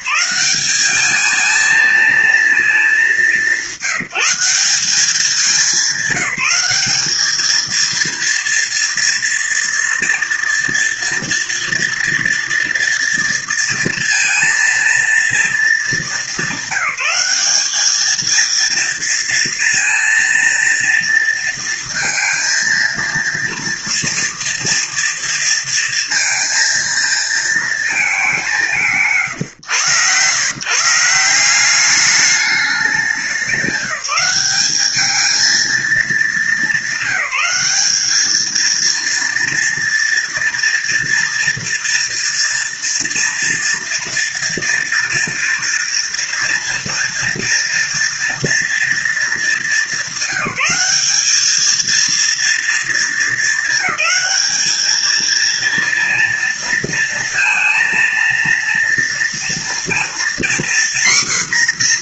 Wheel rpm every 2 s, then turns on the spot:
190, 220, 190, 190, 230, 230, 230, 230, 200, 220, 230, 230, 230, 230, 200, 140, 200, 190, 210, 220, 230, 230, 230, 230, 230, 180, 230, 200, 230, 230, 240.
none